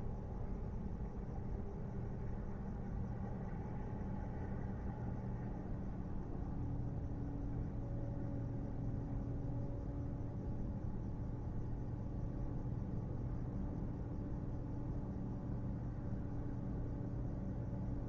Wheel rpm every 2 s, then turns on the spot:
0, 0, 0, 0, 0, 0, 0, 0, 0.
none